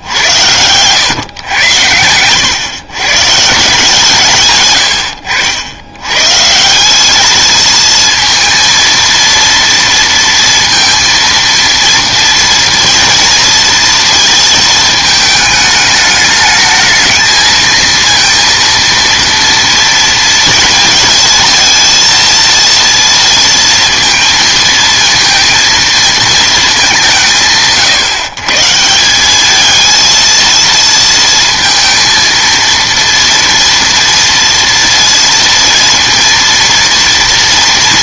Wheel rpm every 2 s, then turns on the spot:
110, 120, 110, 170, 230, 230, 230, 220, 220, 230, 230, 230, 220, 210, 150, 230, 230, 230, 230.
none